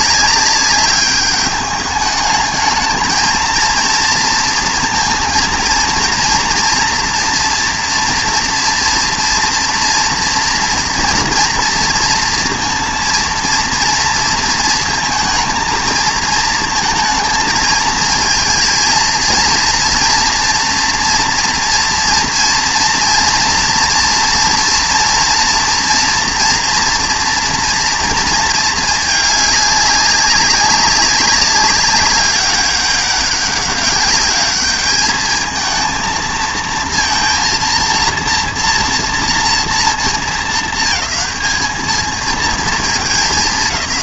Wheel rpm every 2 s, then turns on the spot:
200, 220, 230, 230, 230, 240, 230, 230, 230, 220, 230, 230, 230, 230, 220, 200, 200, 200, 220, 230, 220, 220.
none